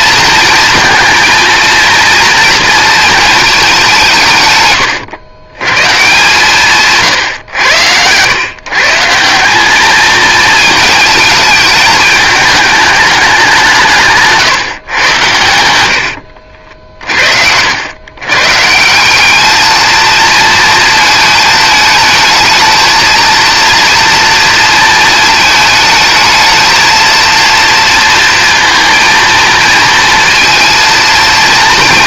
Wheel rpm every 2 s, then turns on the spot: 230, 220, 110, 140, 150, 220, 210, 120, 60, 170, 220, 220, 220, 230, 230, 230.
none